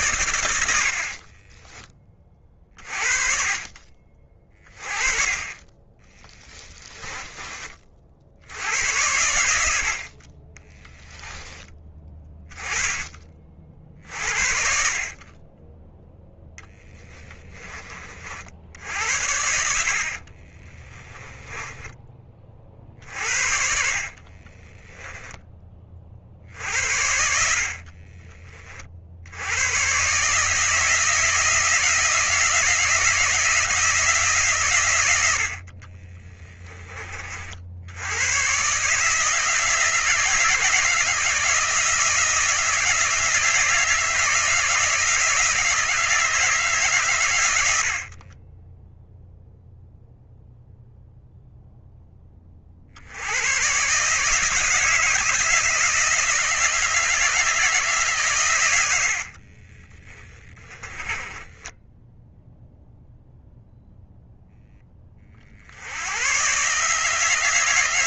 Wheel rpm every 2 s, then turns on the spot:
30, 30, 20, 20, 90, 10, 20, 40, 10, 70, 10, 50, 10, 80, 30, 160, 170, 120, 20, 140, 160, 160, 160, 150, 10, 0, 50, 160, 160, 100, 30, 0, 10, 150.
0-2 6-8 20-28 48-50 60-62